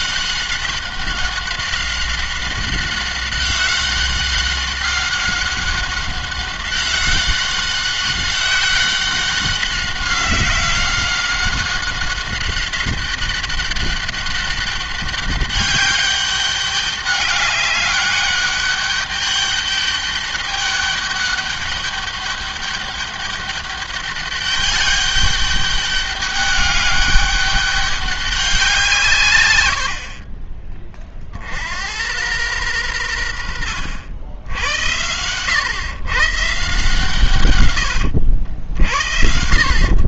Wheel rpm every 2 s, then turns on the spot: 190, 190, 190, 190, 190, 190, 190, 200, 200, 200, 200, 200, 200, 200, 180, 30, 100, 80, 140, 80.
none